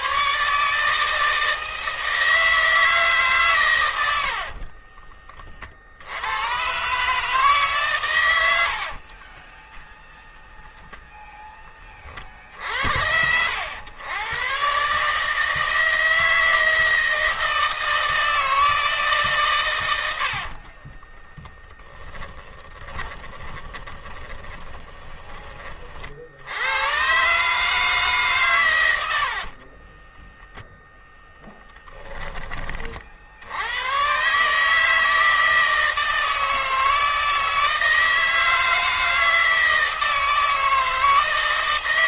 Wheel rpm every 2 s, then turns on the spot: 150, 150, 30, 130, 50, 0, 90, 140, 160, 150, 30, 20, 30, 110, 80, 10, 50, 160, 160, 160, 160.
4-6 8-10 20-24 28-30